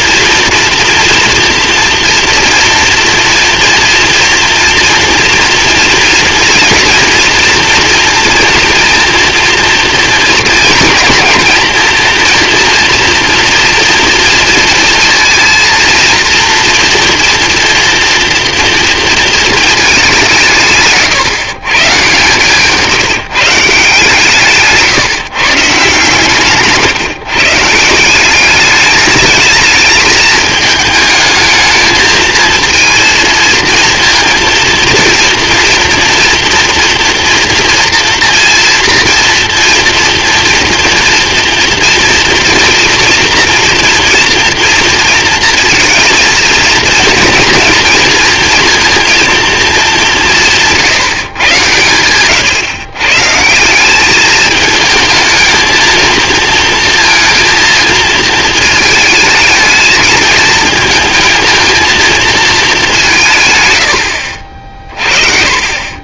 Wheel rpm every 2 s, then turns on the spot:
230, 230, 230, 240, 230, 220, 230, 230, 230, 230, 150, 160, 150, 140, 200, 220, 220, 230, 230, 230, 230, 230, 230, 230, 230, 170, 120, 220, 230, 220, 220, 210, 50.
22-24